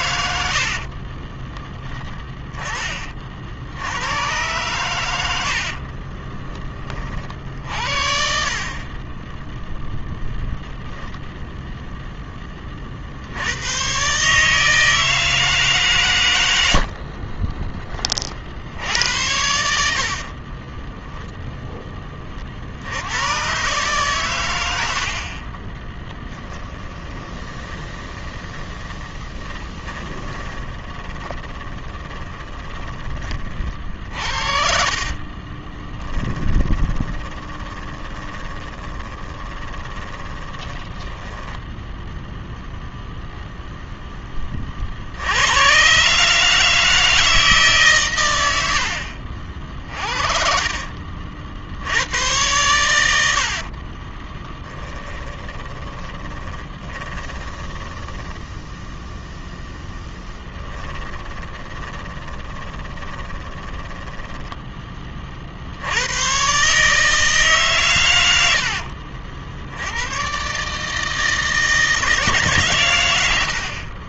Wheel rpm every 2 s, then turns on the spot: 60, 40, 110, 30, 20, 0, 50, 160, 60, 80, 10, 90, 70, 10, 30, 20, 20, 50, 20, 20, 30, 0, 70, 160, 60, 40, 80, 20, 20, 0, 10, 20, 30, 150, 70, 160, 100.
0-2 8-10 20-22 26-32 34-40 54-58 60-64